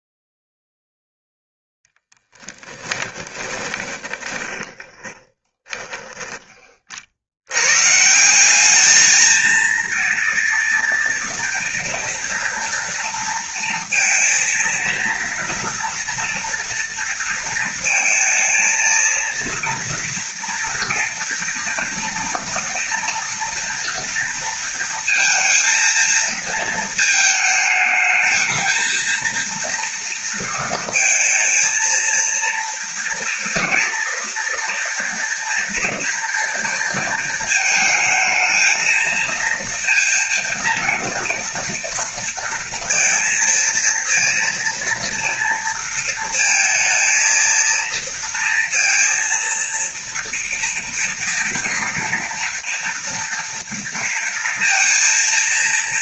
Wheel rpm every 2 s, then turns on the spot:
0, 10, 20, 60, 220, 230, 230, 230, 230, 230, 240, 230, 230, 220, 230, 230, 230, 230, 230, 230, 230, 230, 230, 230, 230, 230, 240, 230.
2-6